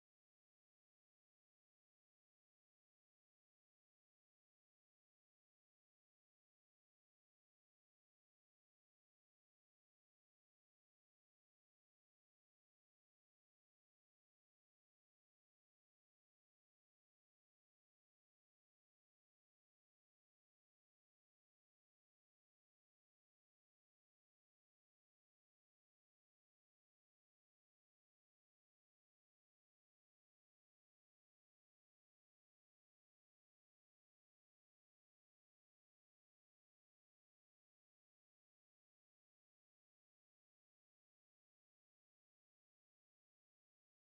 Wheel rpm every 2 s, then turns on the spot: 60, 120, 110, 30, 70, 150, 160, 170, 80, 50, 190, 150, 160, 160, 180, 80, 160, 160, 90, 190, 110, 30.
0-2 8-10 16-20